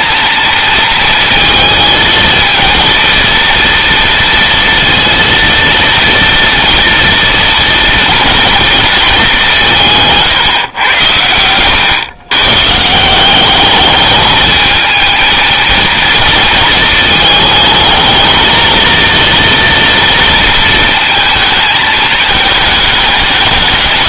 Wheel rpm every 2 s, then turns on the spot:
230, 230, 230, 230, 220, 110, 160, 220, 220, 230, 220, 210.
none